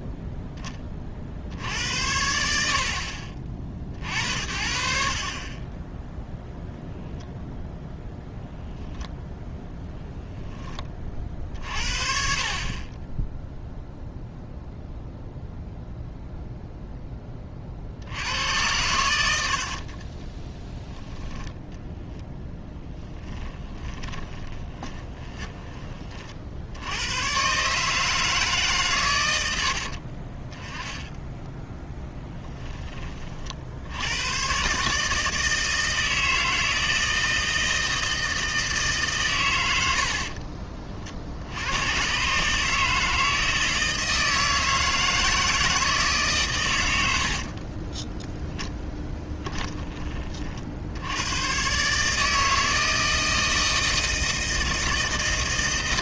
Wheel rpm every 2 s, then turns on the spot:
10, 50, 60, 10, 0, 10, 30, 0, 0, 90, 10, 0, 20, 60, 150, 20, 10, 130, 160, 160, 40, 150, 160, 130, 20, 50, 160, 160.
24-26 48-50